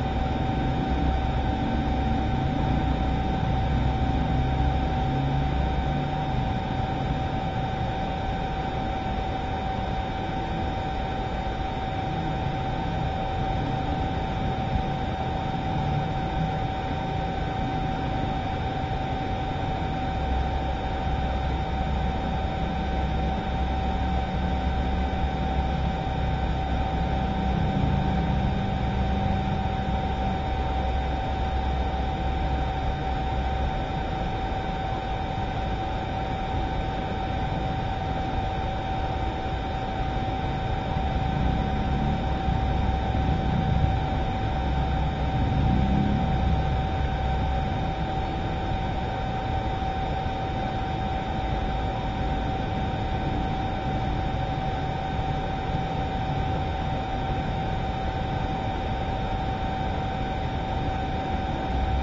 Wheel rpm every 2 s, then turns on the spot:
0, 0, 0, 0, 0, 0, 0, 0, 0, 0, 0, 0, 0, 0, 0, 0, 0, 0, 0, 0, 0, 0, 0, 0, 0, 0, 0, 0, 0, 0, 0.
none